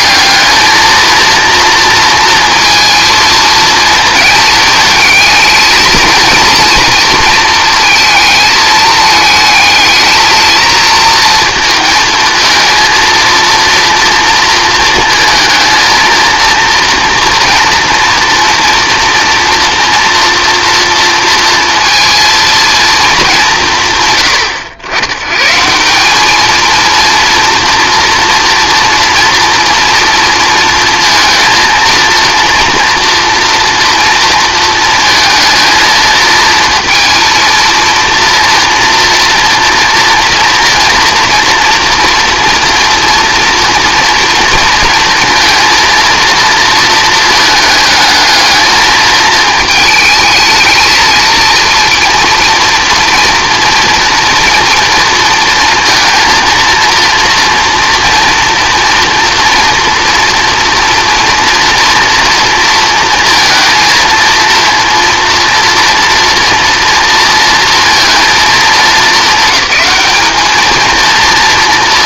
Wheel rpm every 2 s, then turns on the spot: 220, 230, 220, 220, 220, 230, 220, 230, 230, 240, 230, 230, 100, 230, 230, 230, 230, 230, 230, 230, 230, 230, 230, 230, 220, 220, 230, 230, 230, 240, 230, 230, 230, 230, 210, 220.
none